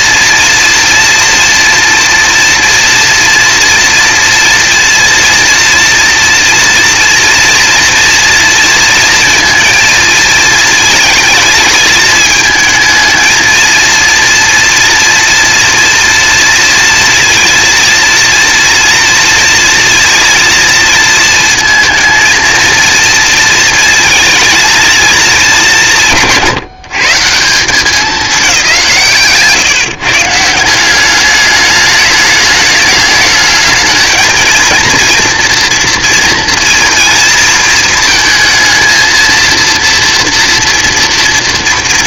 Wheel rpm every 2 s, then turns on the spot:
230, 230, 230, 230, 230, 220, 220, 230, 230, 230, 230, 230, 210, 150, 160, 190, 210, 230, 230, 230, 230.
none